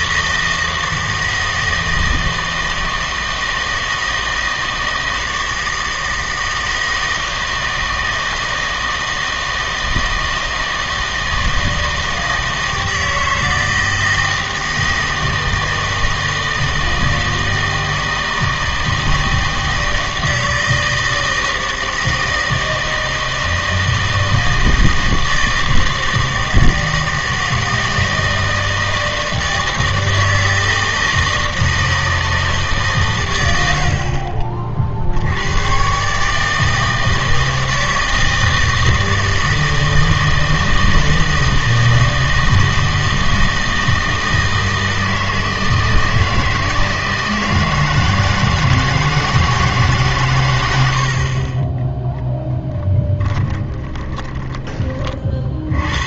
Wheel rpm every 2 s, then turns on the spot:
160, 160, 160, 160, 160, 160, 160, 160, 160, 160, 160, 160, 160, 160, 160, 160, 110, 80, 160, 160, 160, 160, 160, 160, 160, 40, 10, 40.
52-54